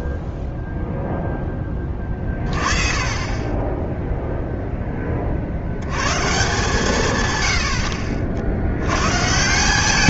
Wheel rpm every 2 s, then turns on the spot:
30, 0, 150, 70, 180.
8-10